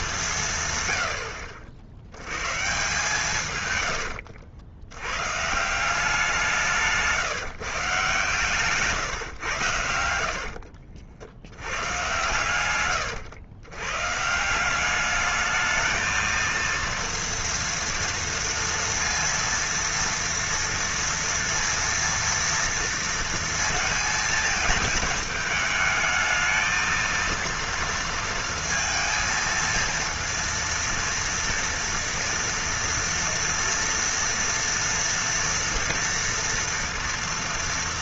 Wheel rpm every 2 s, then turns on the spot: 130, 130, 80, 170, 140, 60, 110, 180, 230, 230, 230, 230, 220, 220, 230, 230, 230, 230, 230.
10-12